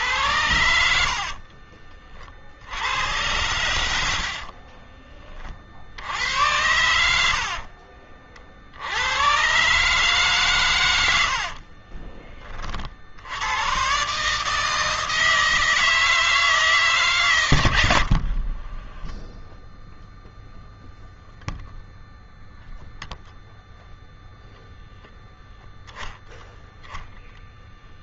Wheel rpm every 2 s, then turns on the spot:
80, 60, 40, 100, 60, 130, 40, 150, 160, 50, 0, 0, 0, 0.
0-2 4-6 18-20